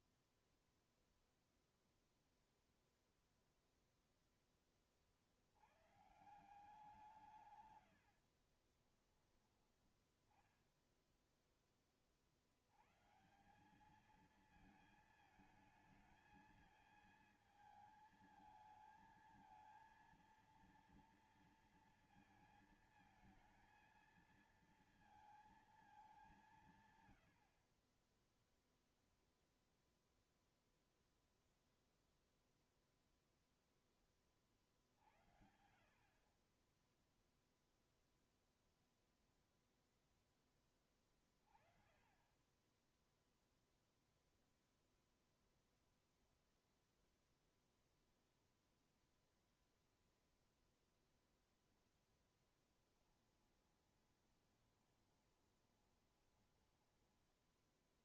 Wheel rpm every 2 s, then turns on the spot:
0, 0, 10, 150, 70, 10, 50, 210, 230, 220, 230, 230, 230, 200, 20, 0, 0, 20, 30, 0, 10, 20, 0, 0, 0, 0, 10, 20, 10.
8-10 54-58